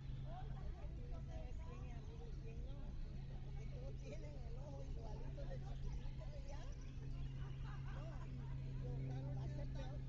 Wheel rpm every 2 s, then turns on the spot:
0, 0, 0, 0, 0.
none